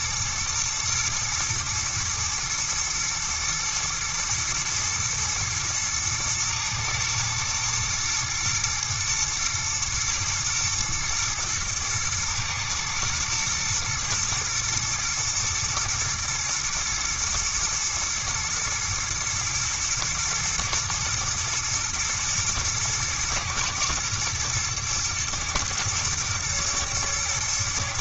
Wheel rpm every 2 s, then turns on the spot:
120, 120, 120, 110, 110, 110, 110, 110, 120, 120, 110, 110, 110, 120.
none